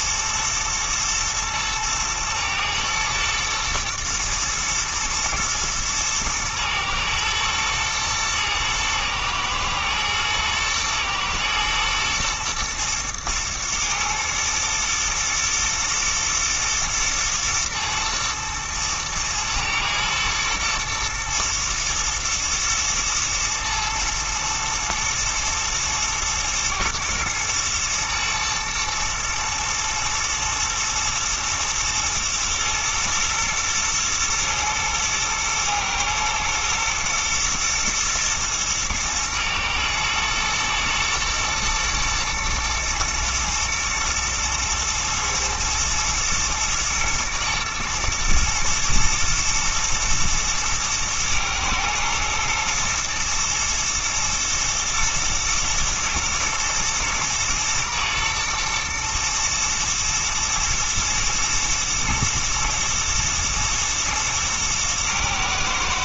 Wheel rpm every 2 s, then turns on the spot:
120, 110, 110, 120, 110, 110, 110, 120, 110, 110, 110, 110, 110, 110, 110, 110, 120, 110, 110, 110, 110, 110, 110, 110, 110, 110, 120, 110, 120, 110, 110, 110, 110.
none